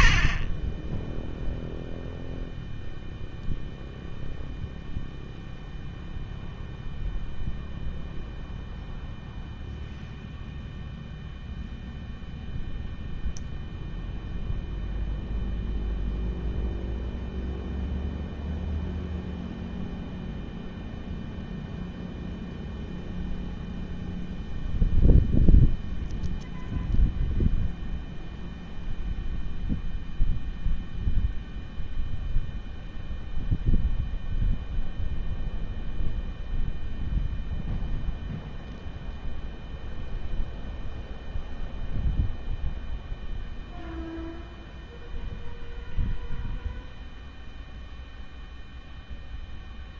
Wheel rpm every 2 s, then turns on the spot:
30, 0, 0, 0, 0, 0, 0, 0, 0, 0, 0, 0, 0, 0, 0, 0, 0, 0, 0, 0, 0, 0, 0, 0, 0.
0-2